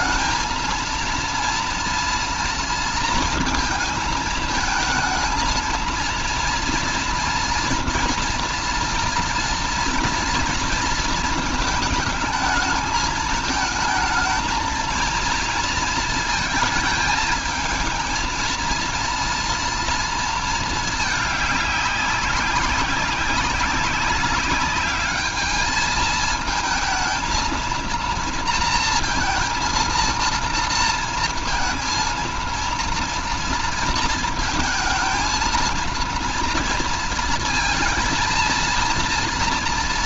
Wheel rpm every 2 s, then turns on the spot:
230, 230, 220, 230, 240, 230, 220, 230, 220, 230, 220, 190, 210, 220, 230, 230, 230, 220, 230, 230.
none